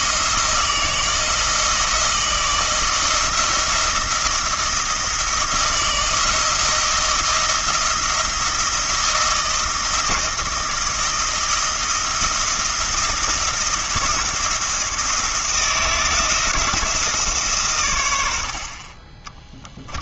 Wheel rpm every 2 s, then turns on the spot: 160, 160, 170, 170, 170, 170, 170, 170, 170, 30.
18-20